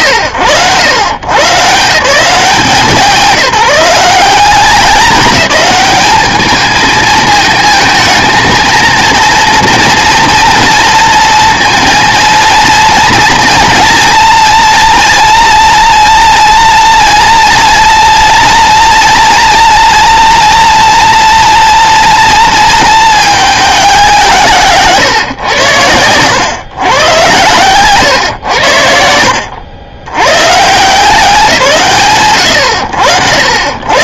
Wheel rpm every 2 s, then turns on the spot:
80, 180, 200, 220, 220, 230, 230, 230, 230, 230, 240, 230, 150, 120, 90, 110, 70.
none